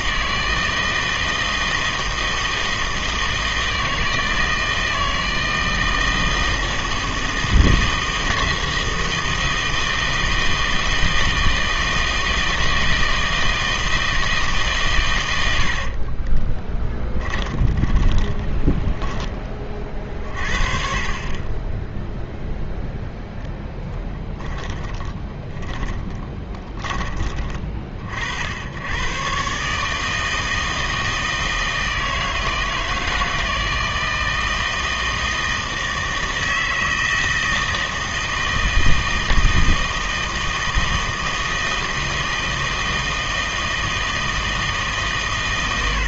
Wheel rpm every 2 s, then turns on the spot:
160, 160, 160, 160, 160, 160, 160, 140, 20, 20, 50, 0, 20, 10, 80, 160, 160, 160, 160, 160, 160, 160, 160.
16-20 24-28